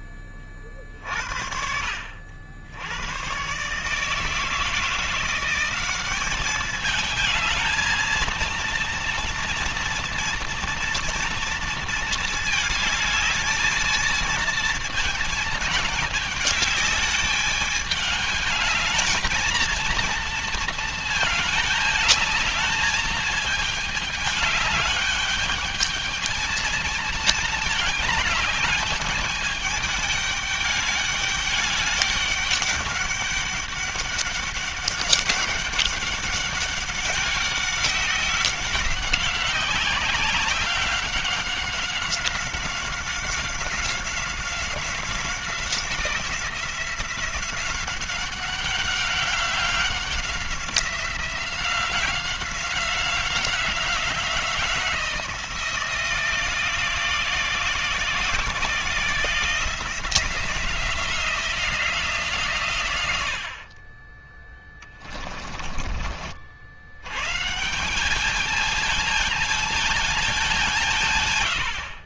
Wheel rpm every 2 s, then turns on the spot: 40, 100, 170, 210, 230, 230, 220, 220, 210, 220, 220, 210, 210, 220, 210, 200, 200, 200, 200, 190, 190, 180, 180, 180, 190, 180, 190, 170, 170, 170, 170, 110, 20, 100, 220, 160.
64-66